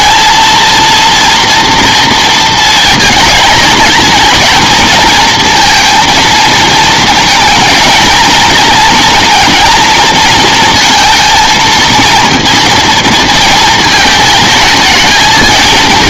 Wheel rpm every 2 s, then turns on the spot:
230, 230, 220, 230, 220, 230, 230, 220.
none